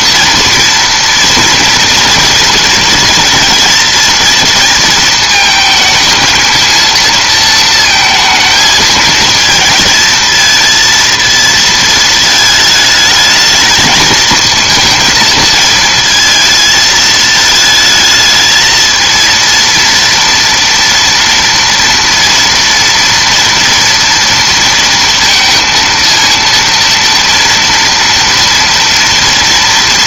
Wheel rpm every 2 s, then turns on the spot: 230, 230, 220, 220, 220, 220, 220, 220, 220, 220, 230, 230, 230, 230, 240.
none